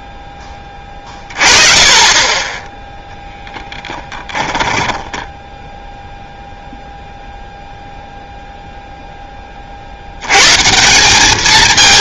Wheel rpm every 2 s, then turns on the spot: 10, 10, 10, 0, 0, 150.
4-6